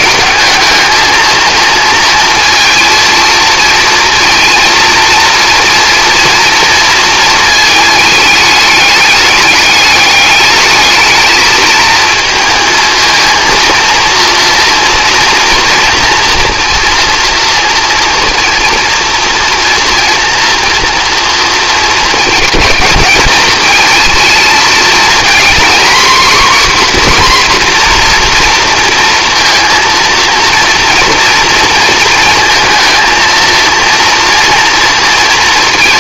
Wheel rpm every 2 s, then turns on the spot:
220, 230, 230, 230, 210, 210, 230, 230, 230, 230, 240, 220, 230, 250, 230, 240, 230, 230.
none